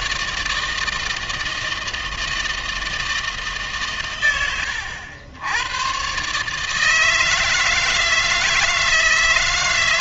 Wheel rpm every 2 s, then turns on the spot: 160, 160, 100, 160, 160.
none